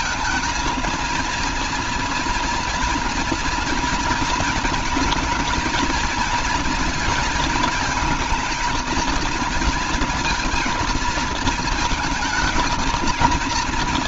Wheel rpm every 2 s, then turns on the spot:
230, 240, 230, 230, 220, 230, 230.
none